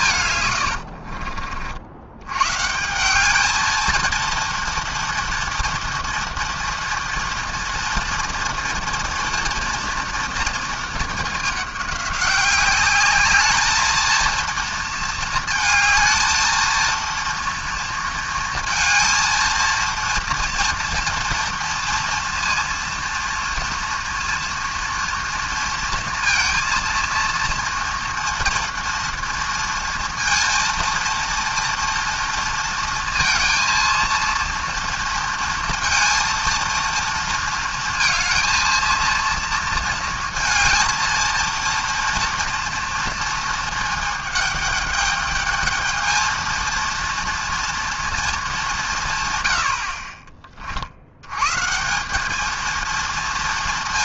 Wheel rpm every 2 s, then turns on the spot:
100, 140, 230, 230, 240, 220, 200, 230, 220, 230, 230, 230, 230, 230, 230, 230, 230, 230, 230, 230, 230, 230, 210, 230, 190, 40, 220.
0-2